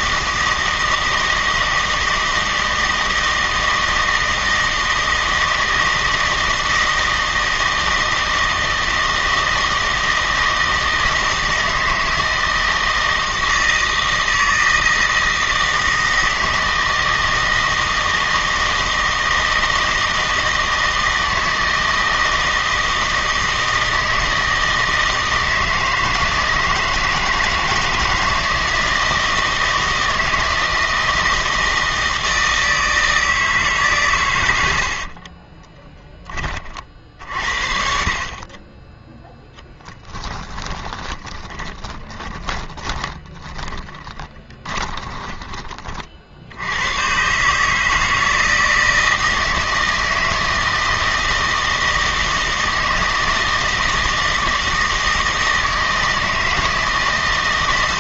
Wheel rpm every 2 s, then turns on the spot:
160, 160, 160, 160, 160, 160, 160, 160, 160, 160, 160, 160, 160, 160, 160, 160, 160, 90, 30, 30, 10, 10, 20, 80, 160, 160, 160, 160, 160.
34-36 40-46